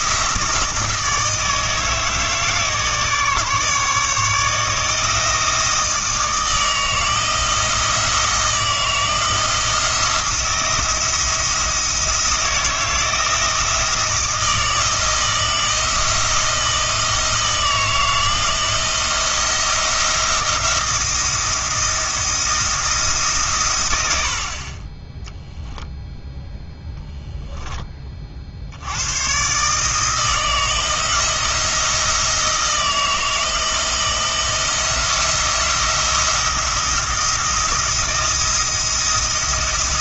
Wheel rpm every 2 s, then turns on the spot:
160, 160, 160, 160, 160, 160, 170, 160, 160, 170, 170, 160, 30, 0, 60, 170, 160, 170, 170, 160.
none